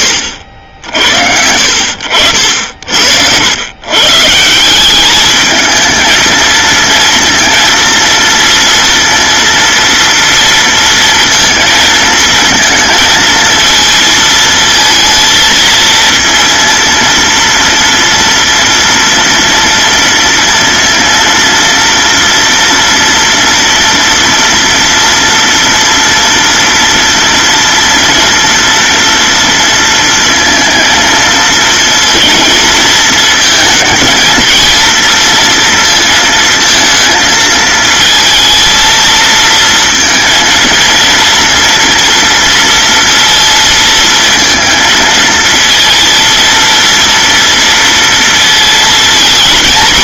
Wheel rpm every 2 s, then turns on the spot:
80, 60, 180, 230, 230, 230, 230, 220, 230, 230, 230, 240, 230, 230, 230, 230, 220, 230, 220, 230, 230, 230, 230, 230, 220.
none